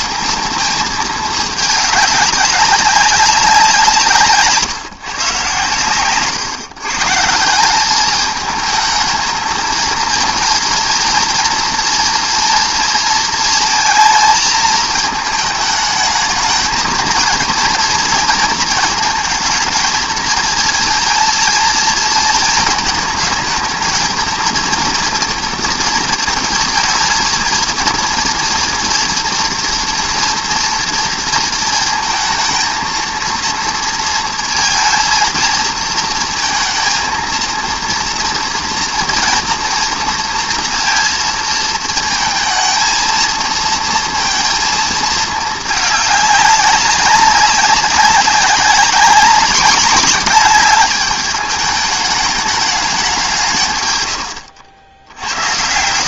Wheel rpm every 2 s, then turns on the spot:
220, 190, 140, 150, 220, 230, 230, 220, 220, 230, 230, 220, 230, 220, 230, 230, 230, 230, 230, 240, 230, 230, 220, 200, 200, 210, 190, 70.
none